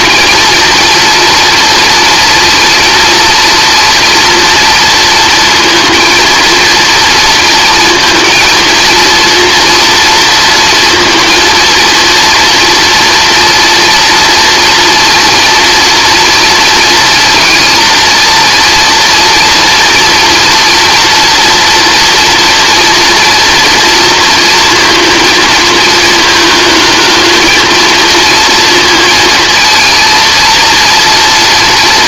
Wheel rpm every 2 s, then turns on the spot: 230, 230, 230, 230, 230, 230, 230, 230, 230, 230, 230, 230, 230, 220, 230, 230.
none